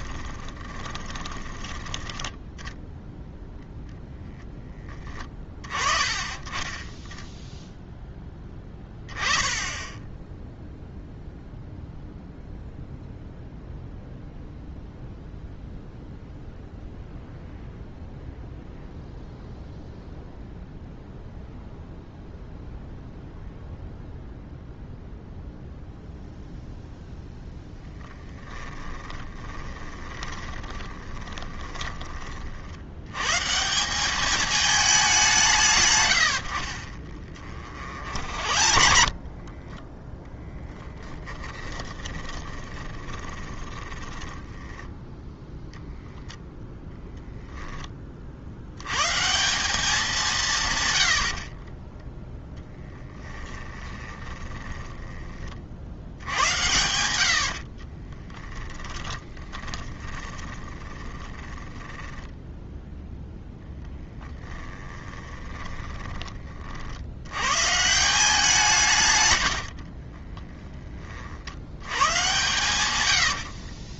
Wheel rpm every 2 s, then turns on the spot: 30, 10, 10, 10, 10, 0, 0, 0, 0, 0, 0, 0, 0, 0, 10, 20, 70, 210, 50, 40, 10, 20, 10, 0, 100, 130, 10, 10, 80, 20, 20, 0, 10, 50, 160, 20, 120.
0-2 28-32 36-38 40-46 52-56 58-62 64-66 72-74